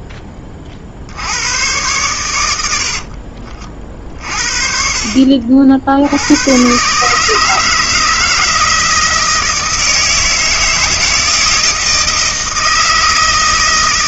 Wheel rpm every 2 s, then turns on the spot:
40, 80, 40, 120, 160, 160, 160.
none